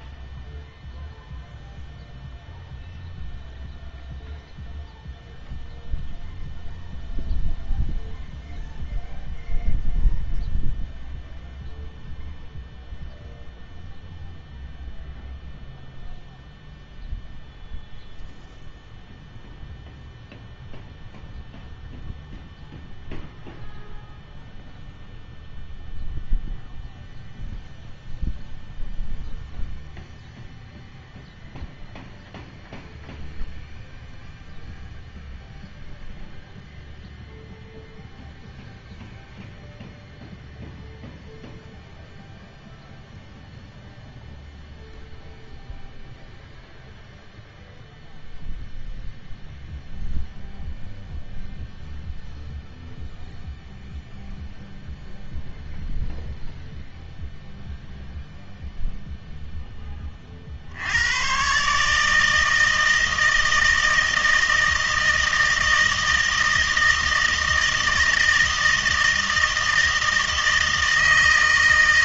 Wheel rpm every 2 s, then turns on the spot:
0, 0, 0, 0, 0, 0, 0, 0, 0, 0, 0, 0, 0, 0, 0, 0, 0, 0, 0, 0, 0, 0, 0, 0, 0, 0, 0, 0, 0, 0, 50, 160, 160, 160, 160, 160.
none